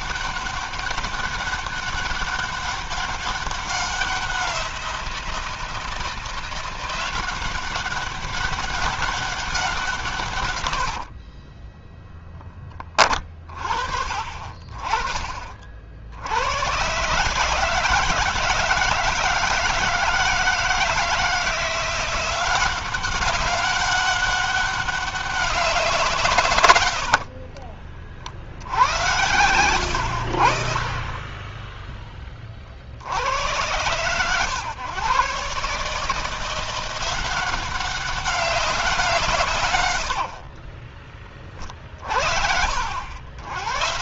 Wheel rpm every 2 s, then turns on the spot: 200, 200, 180, 170, 190, 120, 10, 40, 100, 160, 160, 180, 200, 120, 70, 60, 30, 110, 160, 180, 60, 60.
40-42